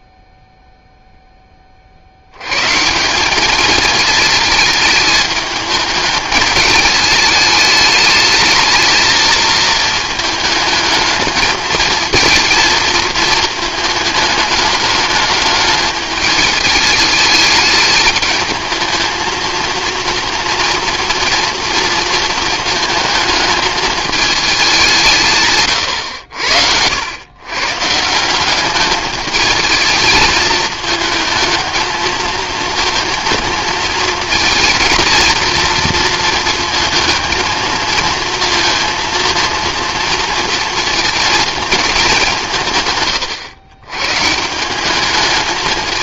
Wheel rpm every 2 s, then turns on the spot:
0, 140, 220, 210, 220, 210, 230, 220, 210, 220, 240, 220, 200, 80, 200, 220, 220, 230, 220, 230, 230, 150, 180.
none